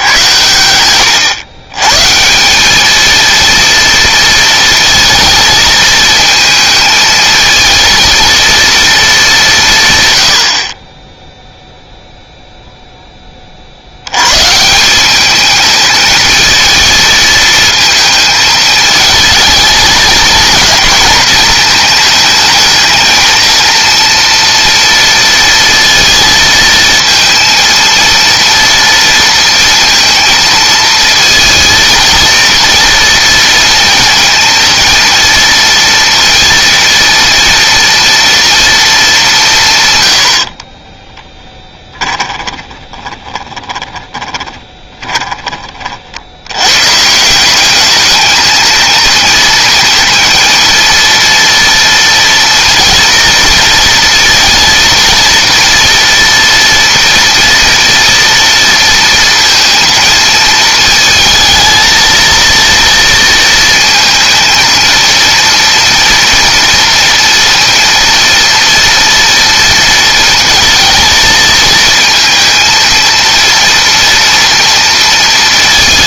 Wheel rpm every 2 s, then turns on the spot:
110, 220, 230, 220, 220, 10, 10, 200, 230, 220, 230, 220, 230, 230, 230, 230, 230, 230, 230, 210, 20, 20, 20, 150, 230, 230, 230, 230, 230, 230, 220, 230, 230, 230, 230, 220, 230, 230.
40-46